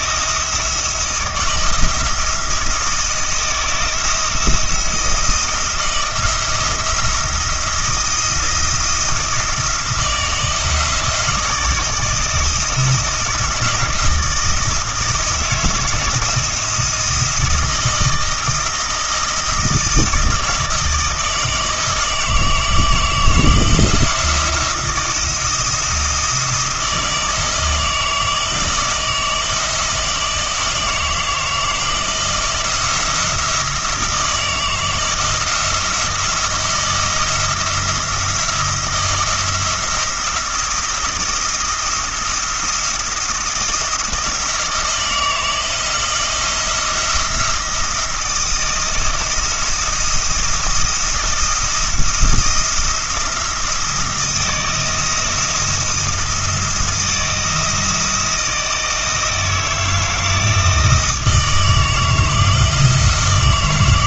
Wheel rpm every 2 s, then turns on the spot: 170, 170, 160, 170, 170, 160, 160, 160, 170, 160, 160, 160, 170, 160, 160, 160, 170, 160, 160, 170, 170, 170, 160, 170, 170, 170, 170, 170, 170, 160, 160, 160.
none